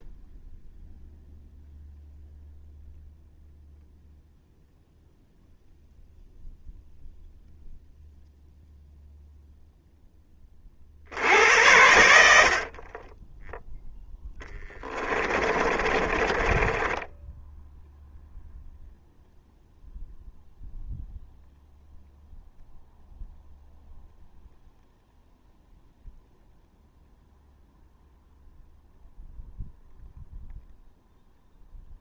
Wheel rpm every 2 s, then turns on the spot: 0, 0, 0, 0, 0, 50, 40, 20, 20, 0, 0, 0, 0, 0, 0, 0.
14-18